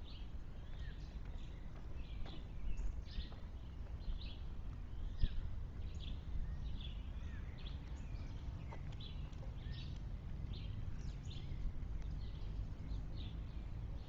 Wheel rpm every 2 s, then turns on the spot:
0, 0, 0, 0, 0, 0, 0.
none